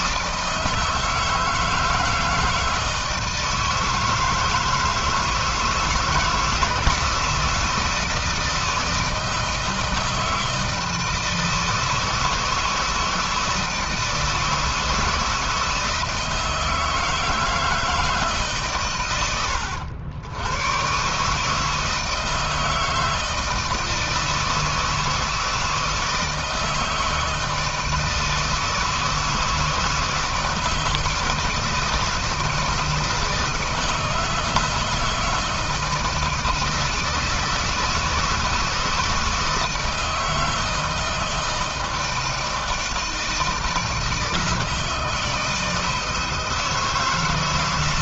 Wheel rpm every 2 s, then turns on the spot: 160, 160, 160, 160, 160, 160, 160, 160, 160, 110, 140, 160, 160, 160, 160, 160, 160, 160, 160, 160, 160, 160, 160, 160.
none